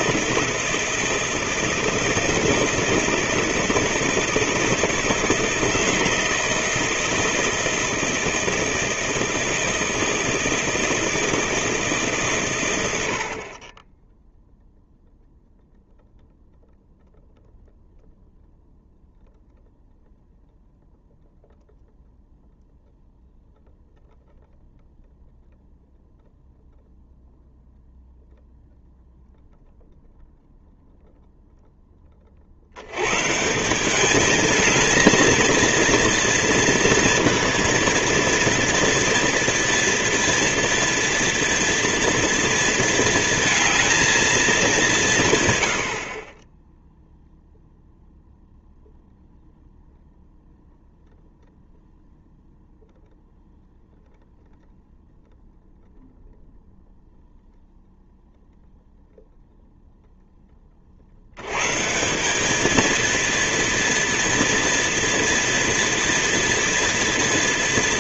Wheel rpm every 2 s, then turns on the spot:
160, 160, 160, 160, 160, 160, 120, 0, 0, 0, 0, 0, 0, 0, 0, 0, 70, 220, 230, 230, 230, 230, 210, 20, 0, 0, 0, 0, 0, 0, 20, 210, 230, 230.
none